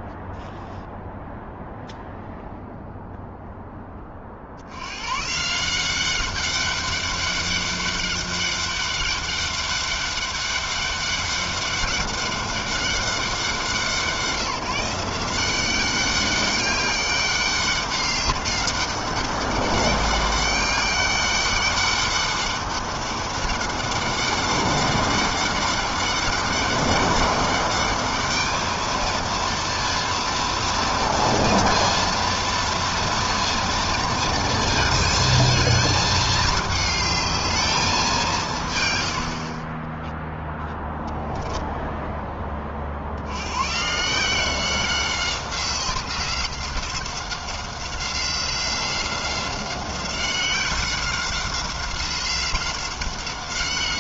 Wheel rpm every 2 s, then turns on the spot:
0, 0, 140, 200, 200, 200, 180, 180, 200, 200, 200, 200, 200, 200, 230, 230, 230, 220, 220, 50, 0, 90, 180, 190, 190, 190, 190.
none